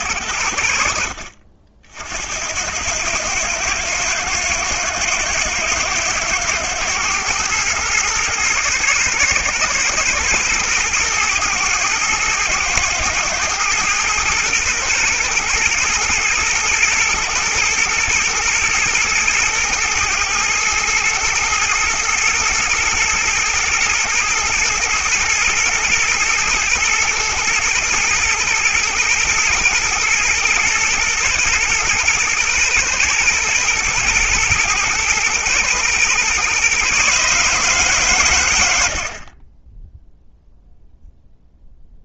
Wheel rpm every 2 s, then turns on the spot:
60, 90, 110, 120, 120, 110, 110, 120, 110, 110, 110, 120, 120, 120, 110, 120, 120, 110, 140, 60, 0.
none